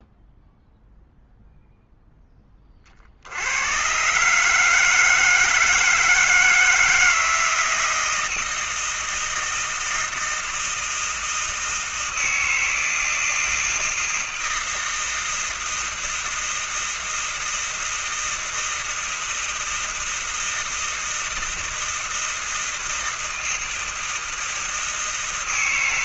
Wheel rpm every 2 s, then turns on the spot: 0, 60, 160, 160, 160, 160, 160, 160, 160, 160, 160, 160, 160.
none